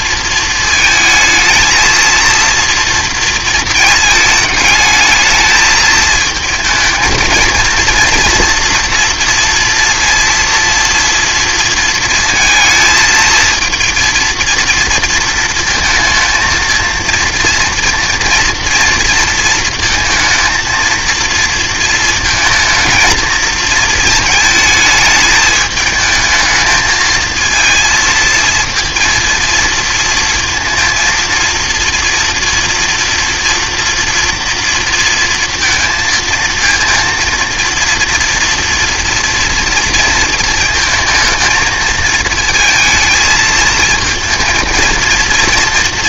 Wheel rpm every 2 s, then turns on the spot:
230, 230, 210, 220, 230, 230, 220, 230, 230, 230, 230, 230, 220, 220, 230, 230, 230, 230, 230, 230, 220, 220, 220.
none